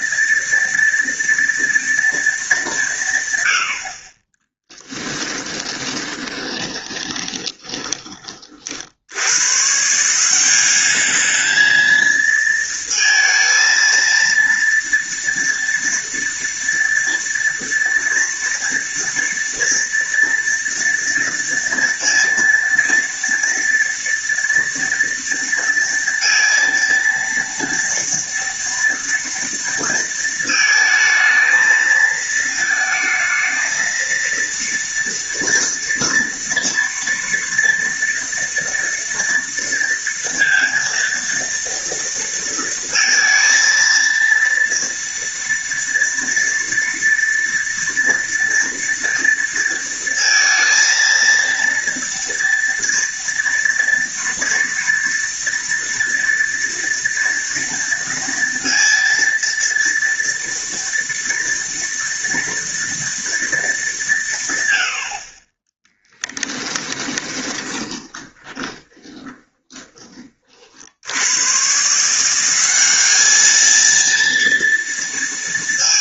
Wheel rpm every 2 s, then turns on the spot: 230, 180, 10, 20, 60, 200, 230, 230, 230, 230, 230, 230, 230, 230, 230, 220, 230, 230, 230, 230, 230, 230, 230, 230, 230, 230, 230, 230, 230, 230, 240, 230, 90, 20, 20, 60, 200, 230.
4-8 66-70